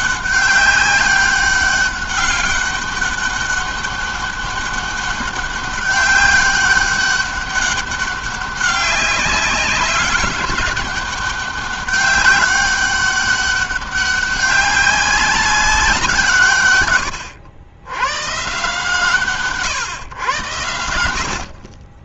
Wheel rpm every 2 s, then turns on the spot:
200, 200, 200, 200, 190, 200, 200, 190, 100, 150, 80.
none